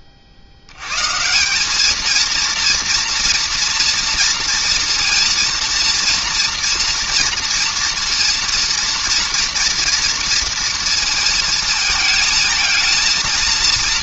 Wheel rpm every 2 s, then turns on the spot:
40, 230, 230, 230, 230, 230, 220.
none